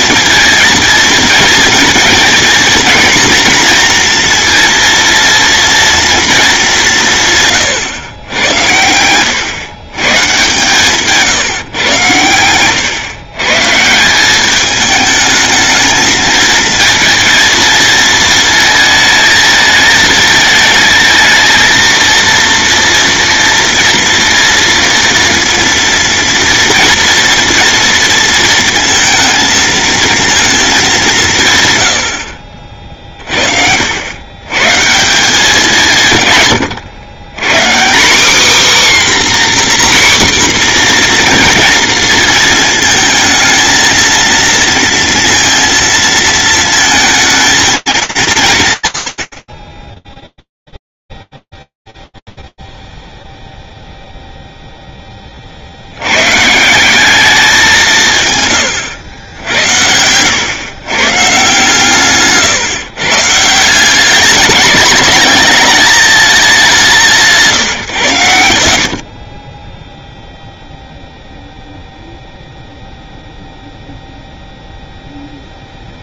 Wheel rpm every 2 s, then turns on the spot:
230, 230, 230, 220, 100, 140, 100, 210, 230, 220, 220, 230, 230, 240, 230, 210, 50, 120, 110, 270, 250, 220, 230, 230, 170, 0, 0, 0, 140, 120, 130, 140, 210, 200, 80, 0, 0, 0.
none